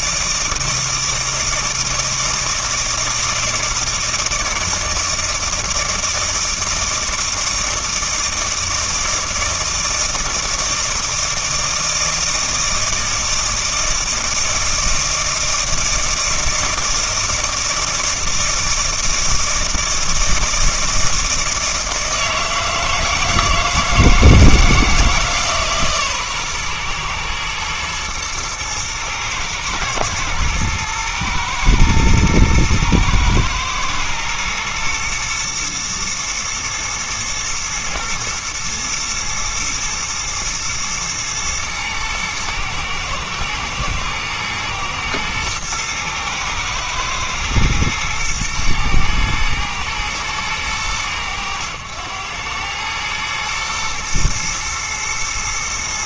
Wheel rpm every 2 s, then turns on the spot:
160, 160, 160, 160, 160, 160, 160, 160, 160, 160, 160, 160, 160, 120, 110, 110, 110, 120, 120, 120, 120, 110, 110, 120, 110, 110, 100, 120.
none